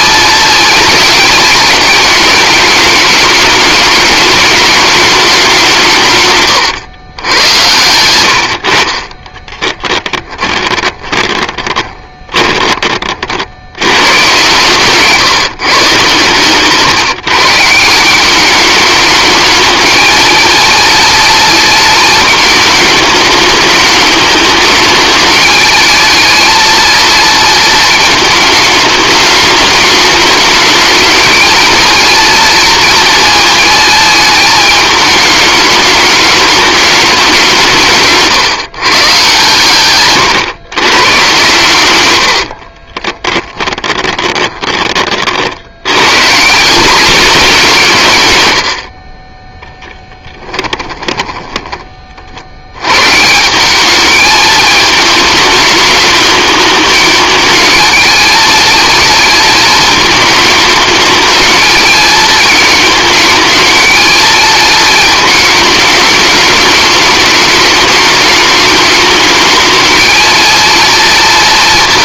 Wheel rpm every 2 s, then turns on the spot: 230, 210, 210, 110, 50, 20, 30, 140, 140, 210, 230, 210, 220, 230, 220, 220, 230, 210, 210, 130, 120, 40, 30, 210, 70, 10, 110, 220, 210, 220, 220, 220, 220, 210, 210, 230.
10-12 42-44 50-52